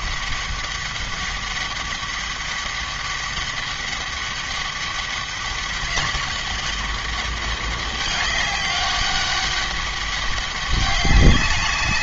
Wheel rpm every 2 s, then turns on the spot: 200, 200, 200, 200, 200, 200.
none